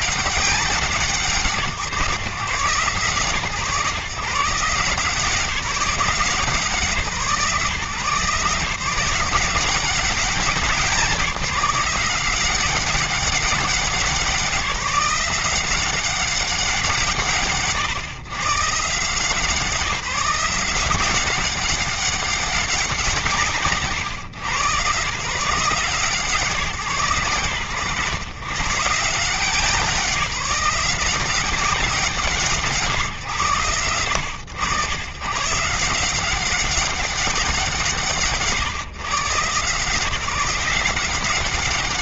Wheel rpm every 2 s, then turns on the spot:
140, 130, 170, 150, 170, 190, 190, 180, 150, 150, 180, 170, 130, 120, 140, 180, 140, 110, 190, 140, 180.
none